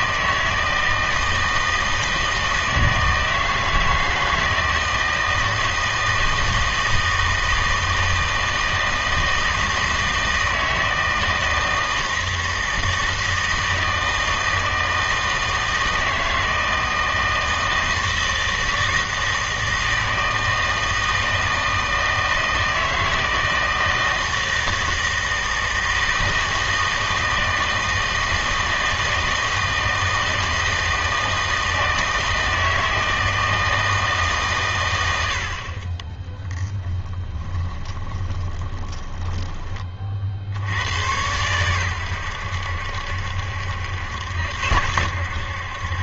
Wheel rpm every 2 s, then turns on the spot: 160, 160, 160, 160, 160, 160, 160, 160, 160, 160, 160, 160, 160, 160, 160, 160, 160, 110, 10, 20, 90, 80, 80.
36-40